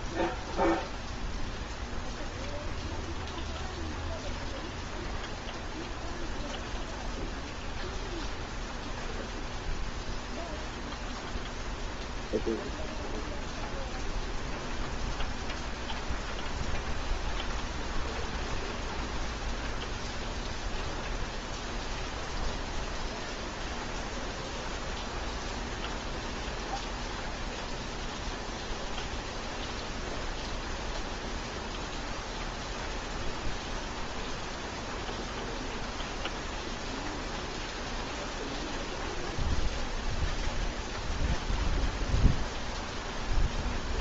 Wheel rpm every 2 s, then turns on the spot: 0, 0, 0, 0, 0, 0, 0, 0, 0, 0, 0, 0, 0, 0, 0, 0, 0, 0, 0, 0, 0, 0.
none